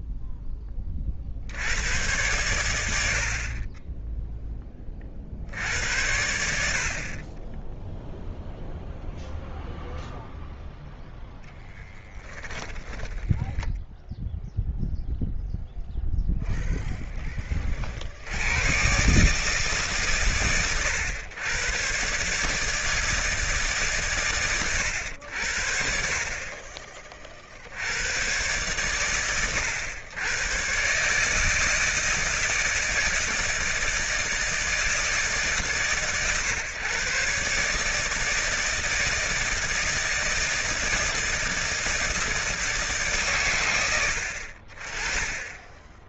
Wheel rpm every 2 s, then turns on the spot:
20, 100, 10, 70, 0, 0, 10, 0, 10, 100, 120, 150, 120, 40, 110, 110, 160, 160, 140, 160, 160, 160, 60.
12-14